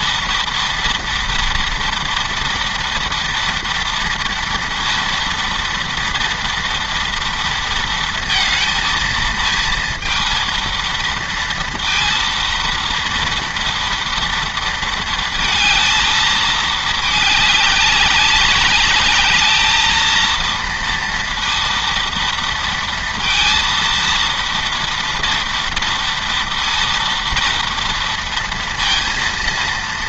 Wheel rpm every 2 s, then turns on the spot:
230, 230, 230, 240, 230, 230, 230, 230, 220, 200, 230, 230, 230, 230, 230.
none